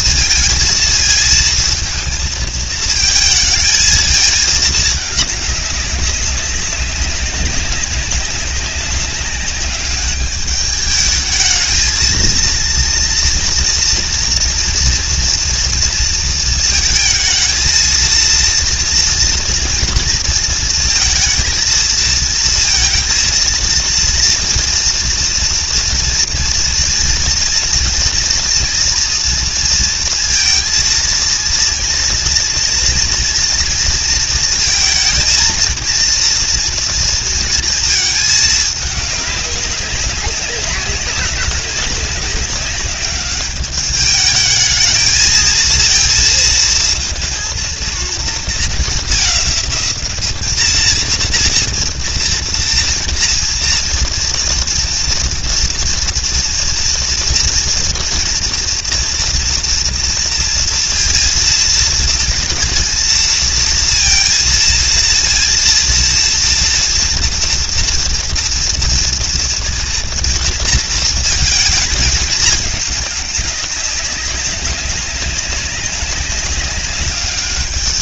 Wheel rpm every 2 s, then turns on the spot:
220, 220, 210, 200, 200, 210, 230, 240, 220, 230, 220, 230, 240, 240, 230, 230, 230, 230, 230, 210, 200, 200, 210, 230, 220, 220, 230, 240, 230, 240, 230, 230, 230, 230, 230, 230, 200, 190, 200.
none